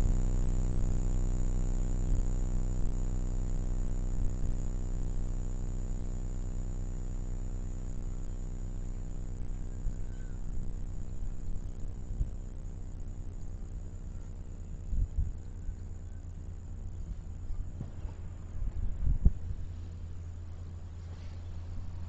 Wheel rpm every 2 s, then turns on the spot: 0, 0, 0, 0, 0, 0, 0, 0, 0, 0, 0.
none